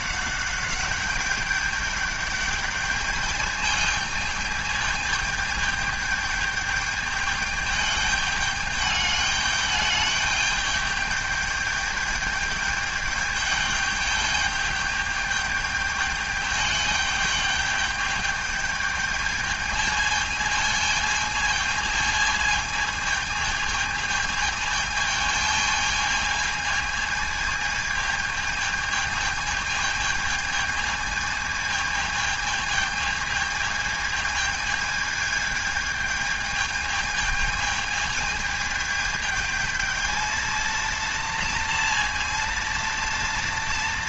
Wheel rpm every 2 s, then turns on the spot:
200, 210, 220, 210, 210, 210, 210, 210, 210, 210, 220, 220, 210, 220, 220, 220, 220, 220, 220, 220, 230, 230.
none